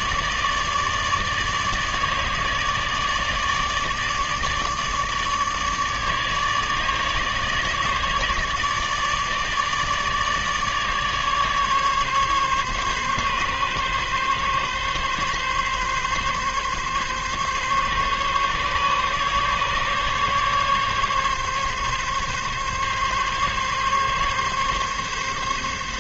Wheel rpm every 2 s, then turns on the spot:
150, 150, 150, 150, 150, 150, 140, 140, 140, 140, 140, 140, 140.
none